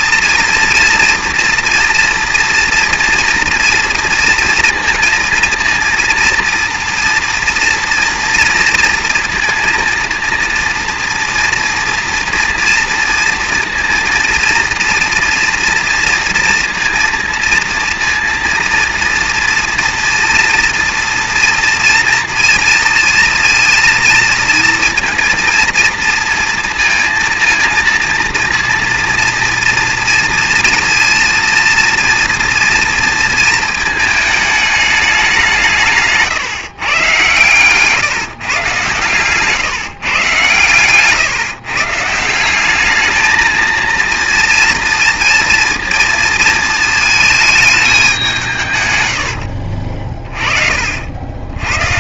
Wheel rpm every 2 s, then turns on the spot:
230, 230, 230, 230, 230, 230, 240, 240, 230, 230, 230, 230, 230, 220, 230, 230, 230, 220, 150, 140, 140, 190, 230, 220, 140, 50.
none